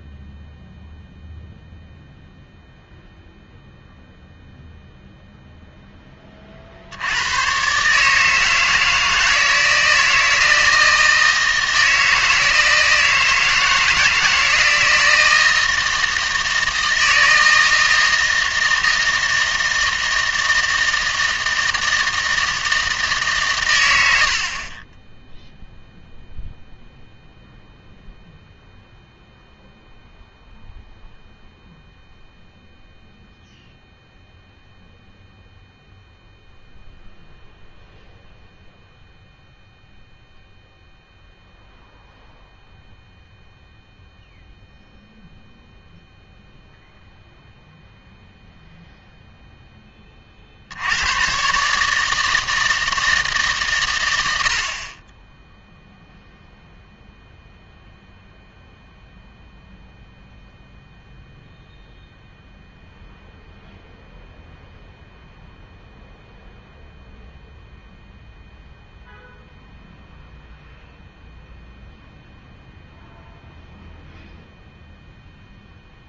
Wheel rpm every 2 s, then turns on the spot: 0, 0, 0, 60, 160, 160, 160, 160, 160, 160, 160, 160, 30, 0, 0, 0, 0, 0, 0, 0, 0, 0, 0, 0, 0, 70, 160, 50, 0, 0, 0, 0, 0, 0, 0, 0, 0, 0.
none